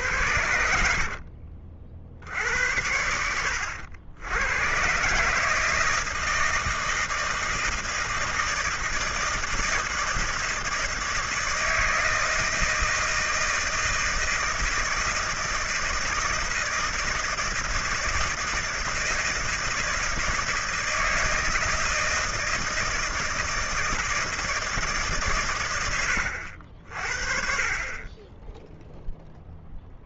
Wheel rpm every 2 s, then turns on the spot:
70, 80, 120, 160, 160, 160, 160, 160, 160, 160, 160, 160, 160, 60, 0.
0-2